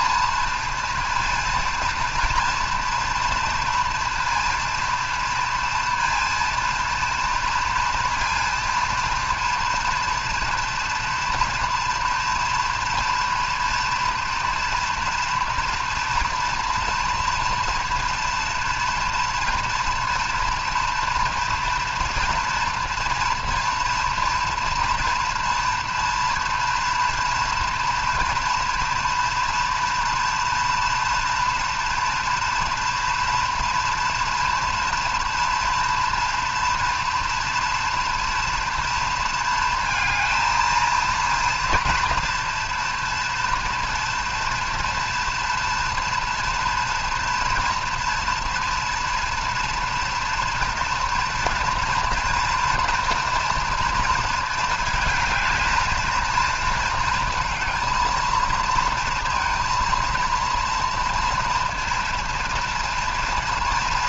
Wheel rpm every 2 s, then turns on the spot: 230, 230, 230, 230, 230, 230, 240, 230, 230, 230, 230, 230, 240, 240, 230, 230, 230, 230, 230, 230, 230, 230, 240, 230, 240, 230, 240, 230, 230, 230, 230, 230.
none